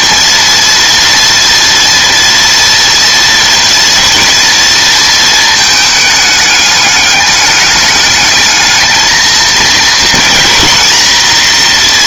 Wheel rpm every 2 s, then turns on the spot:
230, 230, 230, 210, 220, 230.
none